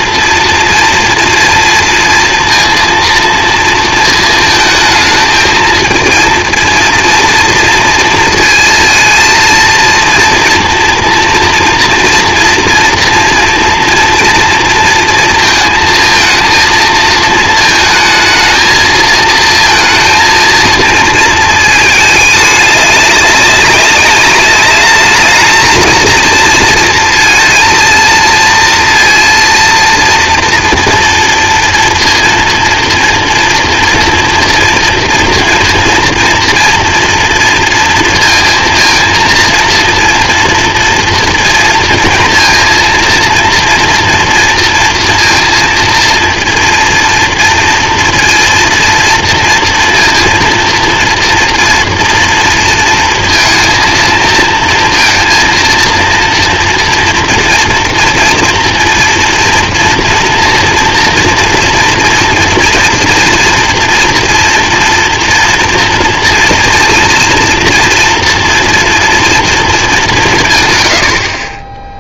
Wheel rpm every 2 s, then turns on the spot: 240, 230, 220, 230, 230, 240, 230, 230, 220, 220, 230, 210, 210, 230, 230, 230, 230, 230, 230, 230, 230, 230, 230, 230, 230, 230, 230, 230, 230, 230, 230, 230, 240, 230, 240, 130.
none